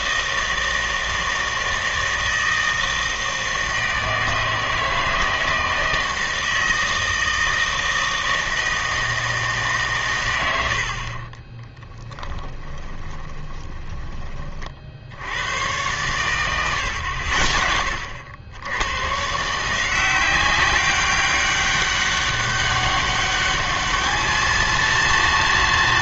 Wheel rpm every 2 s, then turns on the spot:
160, 160, 160, 160, 160, 80, 20, 40, 110, 110, 190, 200, 230.
12-14